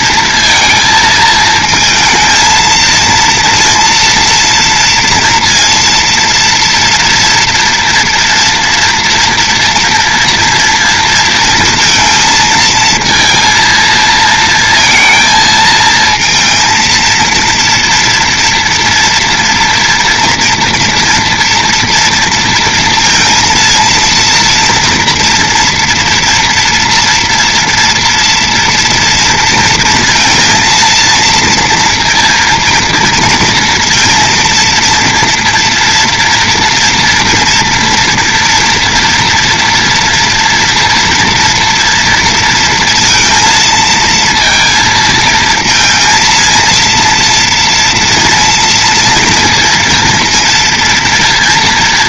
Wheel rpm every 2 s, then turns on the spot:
230, 220, 230, 230, 240, 230, 220, 230, 230, 230, 230, 230, 230, 240, 230, 230, 230, 230, 230, 230, 230, 230, 230, 230, 230, 230.
none